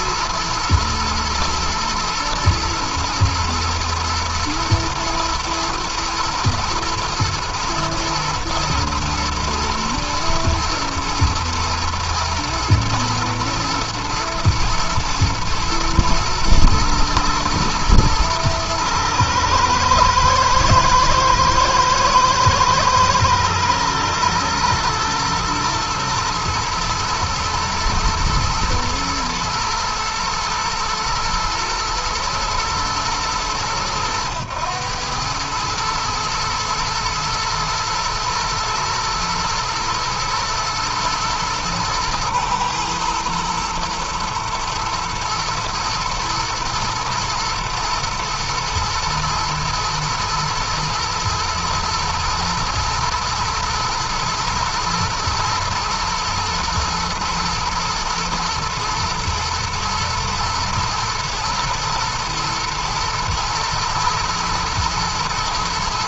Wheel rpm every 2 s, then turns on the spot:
120, 110, 110, 110, 110, 110, 110, 110, 110, 110, 110, 110, 120, 110, 120, 120, 120, 100, 110, 120, 120, 110, 110, 120, 120, 120, 120, 120, 110, 110, 120, 110, 120.
none